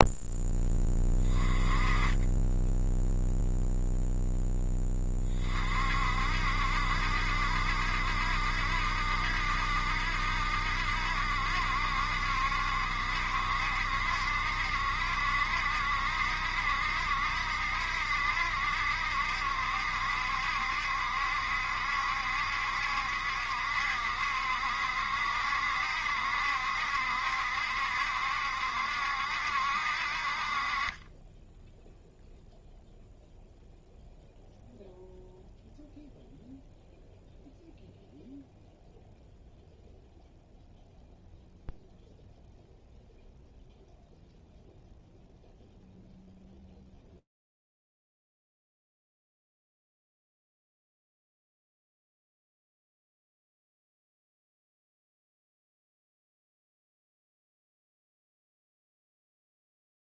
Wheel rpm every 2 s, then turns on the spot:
20, 0, 20, 70, 70, 70, 70, 70, 70, 70, 70, 70, 70, 70, 70, 20, 0, 0, 0, 0, 0, 0, 0, 0, 0, 0, 30, 0, 0, 0.
none